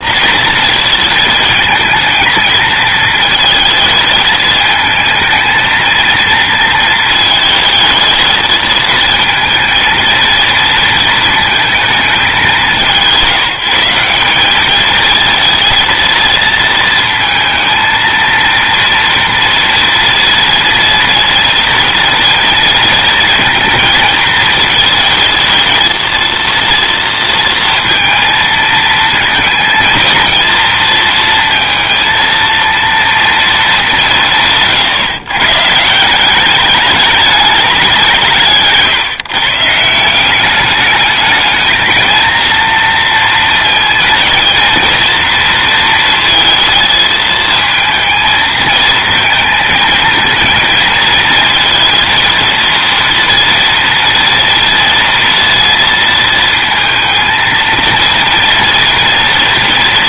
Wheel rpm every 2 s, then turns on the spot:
230, 220, 220, 230, 220, 230, 180, 210, 230, 230, 230, 230, 220, 230, 220, 220, 230, 140, 200, 150, 200, 230, 230, 220, 220, 230, 230, 230, 230, 230.
38-40